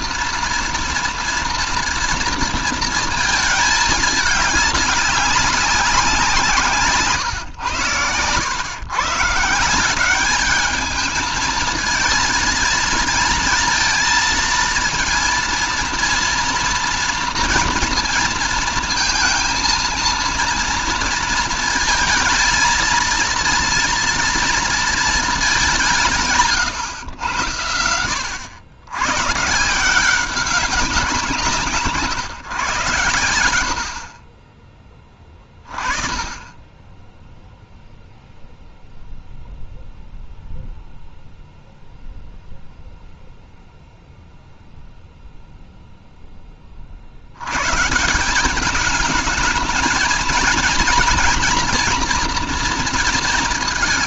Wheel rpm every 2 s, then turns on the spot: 230, 220, 200, 140, 140, 220, 220, 230, 230, 230, 230, 230, 220, 120, 130, 180, 110, 20, 10, 0, 0, 0, 0, 50, 210, 230, 220.
6-8